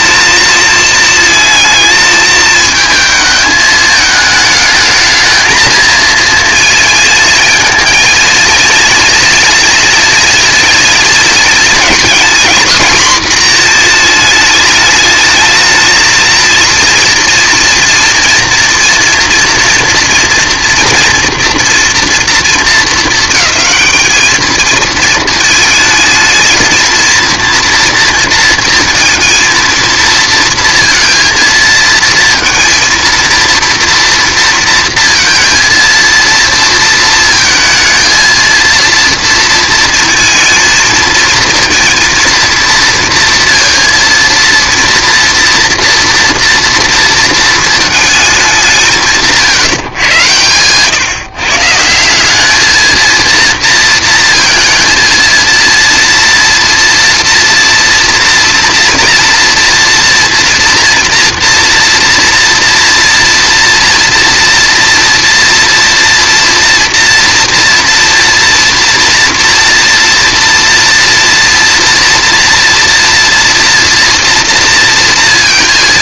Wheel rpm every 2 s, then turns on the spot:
220, 220, 220, 230, 230, 230, 250, 210, 230, 230, 230, 230, 220, 220, 230, 230, 230, 230, 230, 230, 230, 230, 230, 230, 190, 120, 210, 230, 230, 230, 230, 230, 230, 240, 230, 230, 230, 230.
none